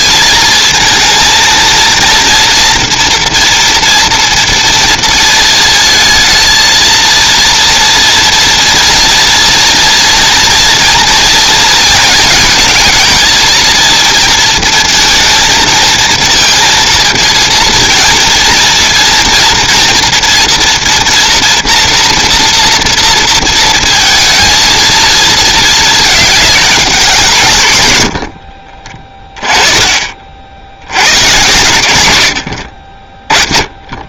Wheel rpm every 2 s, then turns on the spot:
230, 230, 230, 220, 230, 230, 230, 230, 220, 230, 230, 230, 220, 210, 70, 60, 70.
28-30 32-34